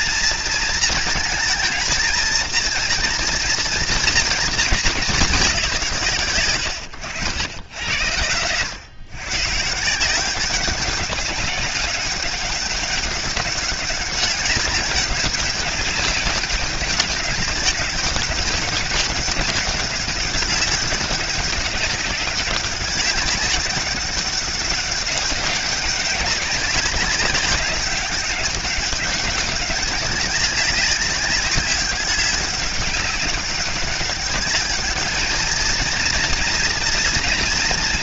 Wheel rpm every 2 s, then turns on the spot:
230, 230, 210, 100, 120, 190, 200, 200, 200, 200, 200, 200, 190, 200, 190, 190, 200, 210, 230.
none